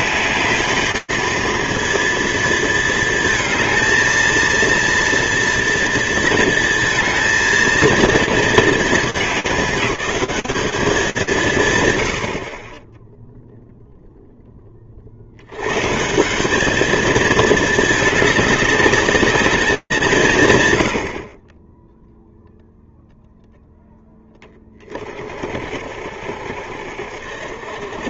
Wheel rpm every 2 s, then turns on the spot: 210, 230, 230, 230, 220, 200, 50, 40, 210, 200, 110, 0, 30, 70.
none